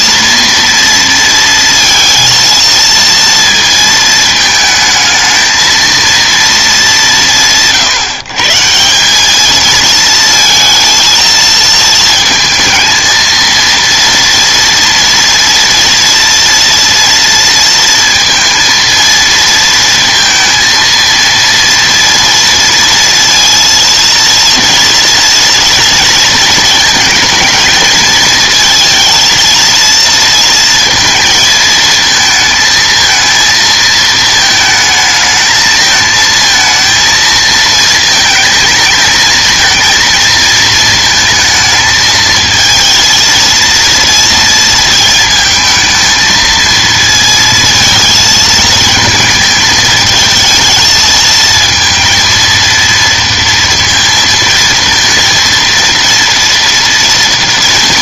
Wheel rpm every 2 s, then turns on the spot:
230, 230, 220, 220, 160, 230, 220, 230, 230, 230, 230, 230, 230, 230, 230, 230, 220, 220, 230, 220, 220, 220, 230, 230, 220, 220, 230, 230, 230.
none